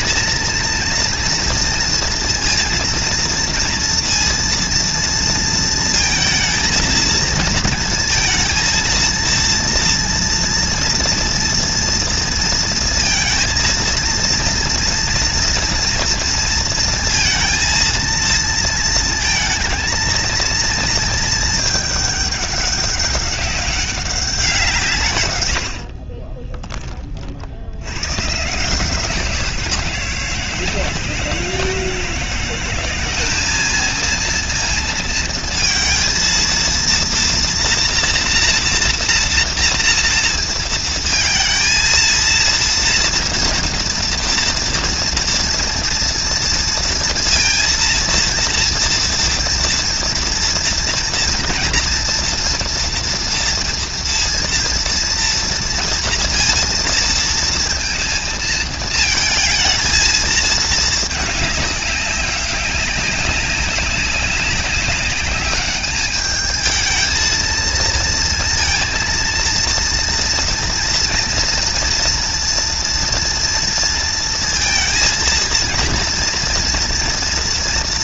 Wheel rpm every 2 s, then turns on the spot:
230, 230, 230, 230, 230, 230, 230, 230, 230, 230, 230, 210, 170, 20, 160, 170, 180, 230, 230, 230, 220, 230, 230, 230, 230, 230, 230, 230, 230, 220, 220, 190, 200, 220, 230, 240, 240, 230, 230.
none